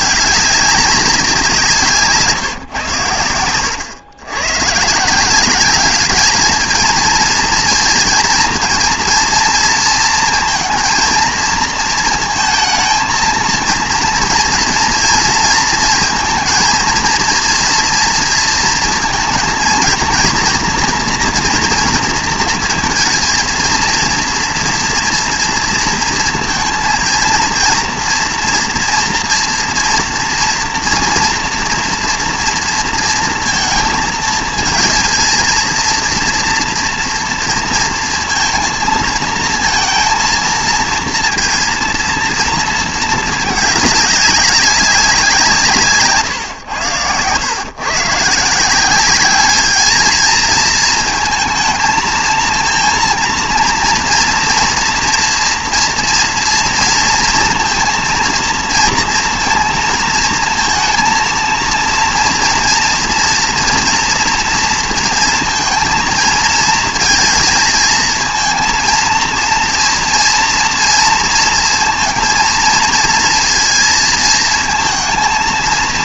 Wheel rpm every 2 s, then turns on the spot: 210, 160, 130, 230, 230, 230, 230, 230, 230, 230, 230, 230, 230, 230, 230, 230, 230, 230, 230, 230, 230, 230, 190, 110, 170, 220, 230, 230, 230, 230, 230, 230, 240, 230, 230, 230, 230, 230.
none